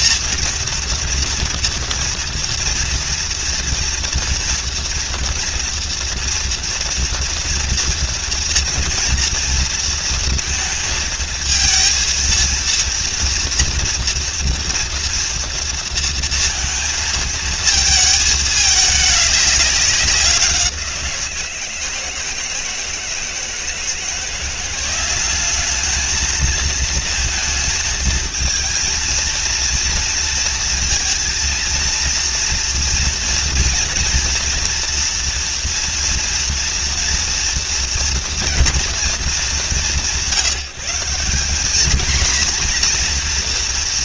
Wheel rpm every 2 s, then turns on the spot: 230, 230, 230, 230, 230, 220, 230, 230, 230, 210, 170, 160, 180, 220, 230, 230, 230, 230, 230, 240, 180, 240.
none